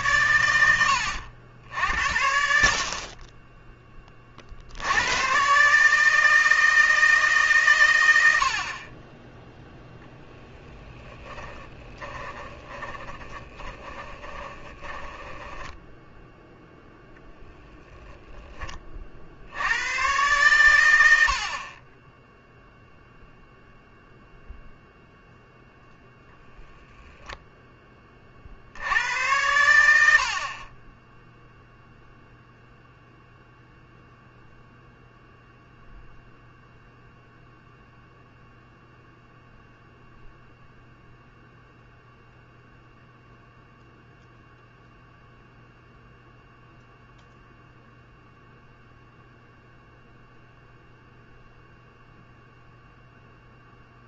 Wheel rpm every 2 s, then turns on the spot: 100, 50, 70, 160, 30, 10, 20, 20, 0, 30, 100, 0, 0, 0, 70, 30, 0, 0, 0, 0, 0, 0, 0, 0, 0, 0, 0.
10-16